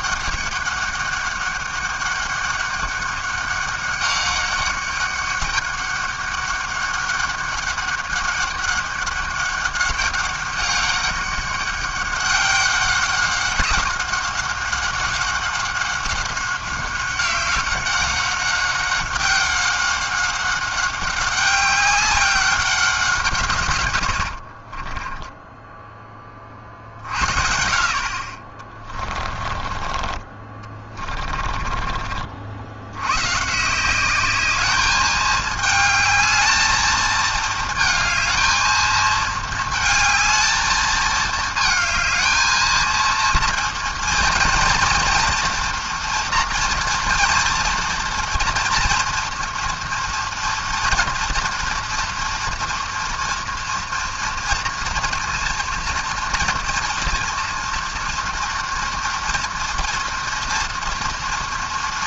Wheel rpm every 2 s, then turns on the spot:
200, 200, 200, 200, 200, 200, 190, 190, 190, 190, 200, 200, 50, 40, 40, 20, 70, 210, 220, 220, 220, 220, 230, 230, 230, 230, 230, 230, 230, 230, 230.
24-26 28-32